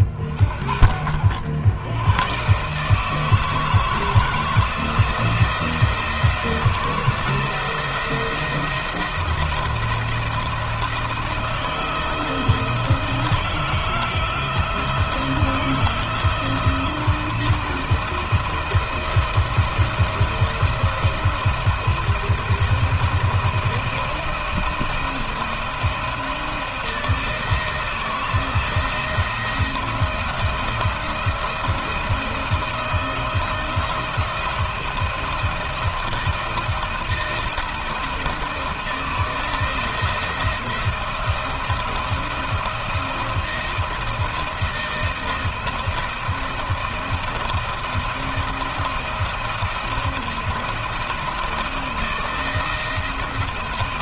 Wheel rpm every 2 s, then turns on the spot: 50, 140, 160, 170, 170, 170, 160, 160, 160, 170, 170, 170, 170, 170, 170, 170, 170, 170, 170, 170, 170, 170, 170, 170, 170, 170, 170.
none